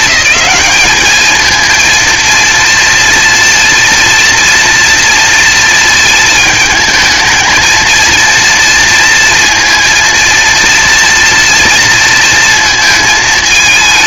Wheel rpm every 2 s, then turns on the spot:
210, 230, 230, 220, 230, 230, 220.
none